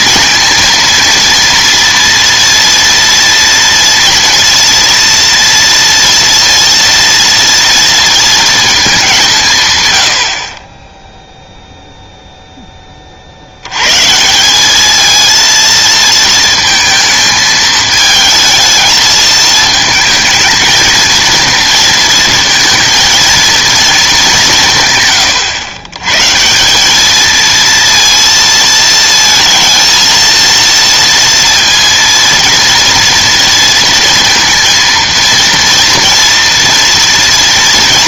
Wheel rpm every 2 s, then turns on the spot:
230, 230, 230, 230, 220, 20, 10, 200, 230, 220, 230, 230, 170, 170, 230, 230, 230, 230, 230.
none